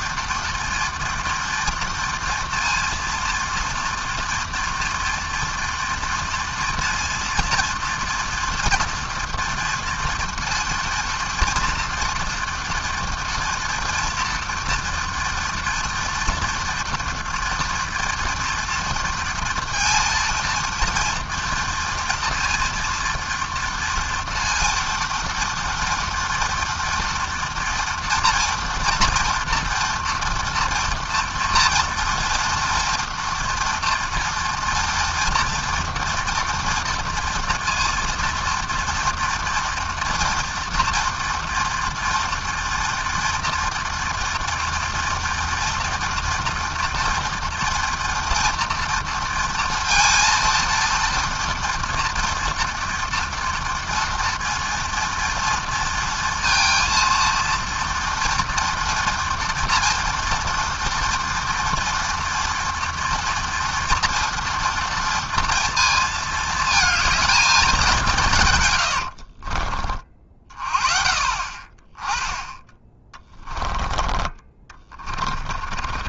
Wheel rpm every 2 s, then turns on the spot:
230, 230, 230, 230, 230, 230, 230, 240, 240, 230, 230, 230, 240, 230, 230, 230, 230, 230, 230, 240, 230, 230, 230, 230, 230, 240, 230, 230, 230, 230, 230, 230, 230, 220, 60, 40, 10, 30.
68-70 74-76